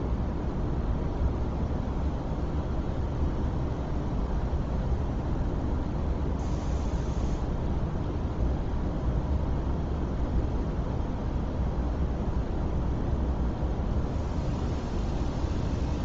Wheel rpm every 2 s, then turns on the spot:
0, 0, 0, 0, 0, 0, 0, 0.
none